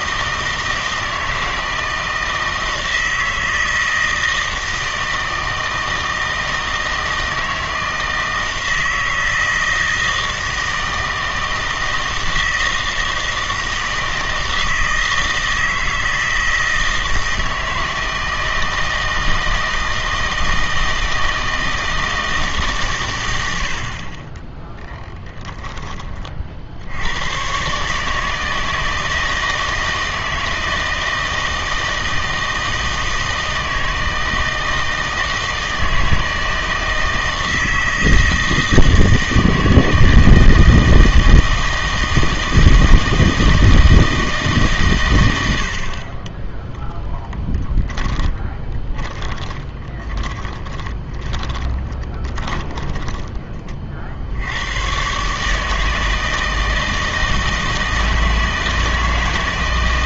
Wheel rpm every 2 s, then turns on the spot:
160, 160, 160, 160, 160, 160, 160, 160, 160, 160, 160, 150, 10, 60, 160, 160, 160, 160, 160, 160, 160, 160, 140, 10, 20, 30, 20, 90, 160, 160.
24-26 48-54